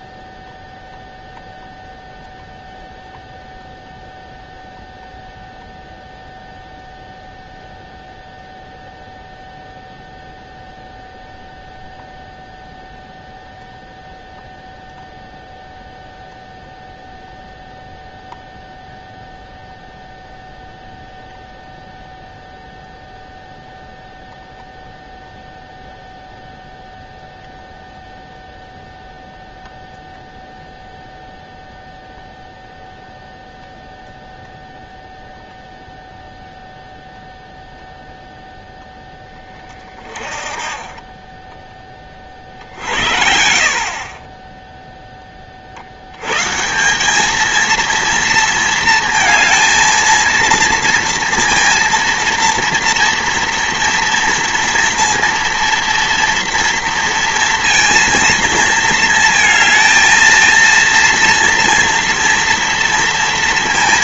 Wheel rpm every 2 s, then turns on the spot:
0, 0, 0, 0, 0, 0, 0, 0, 0, 0, 0, 0, 0, 0, 0, 0, 0, 0, 0, 0, 40, 40, 30, 130, 230, 230, 230, 230, 230, 230, 230, 230.
none